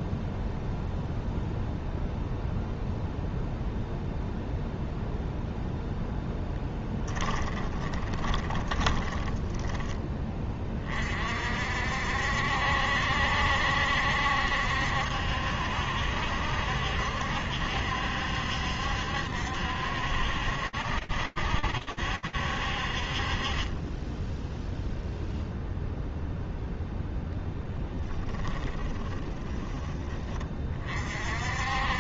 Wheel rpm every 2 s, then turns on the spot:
0, 0, 0, 10, 20, 30, 70, 70, 70, 70, 60, 40, 0, 0, 10, 50.
6-10 28-30